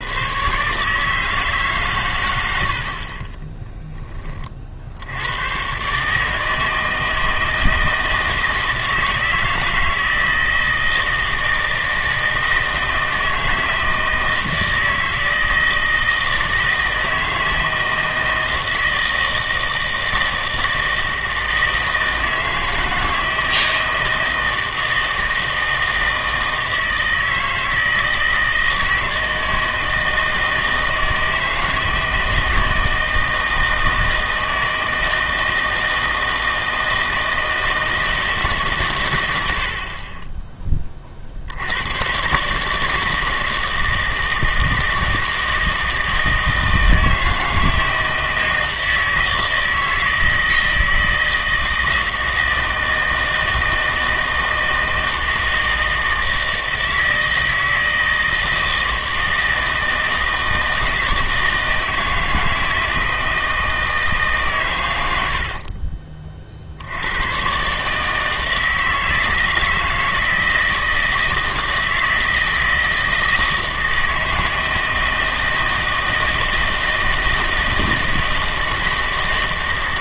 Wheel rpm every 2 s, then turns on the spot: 130, 80, 50, 160, 160, 160, 160, 160, 160, 160, 160, 160, 160, 160, 160, 160, 160, 160, 160, 150, 20, 140, 160, 160, 160, 160, 160, 160, 160, 160, 160, 160, 120, 60, 160, 160, 160, 160, 160, 160.
none